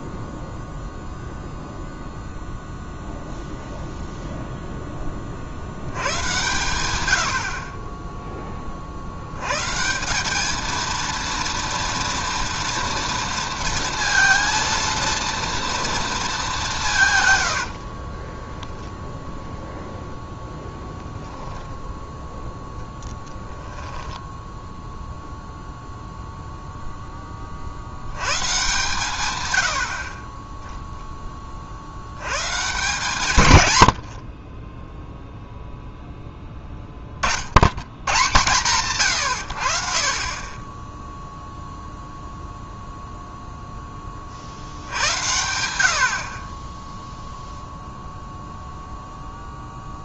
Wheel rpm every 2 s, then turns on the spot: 0, 0, 0, 110, 30, 220, 230, 230, 200, 10, 0, 0, 0, 0, 130, 10, 140, 20, 10, 140, 20, 0, 60, 20, 0.
18-20 46-48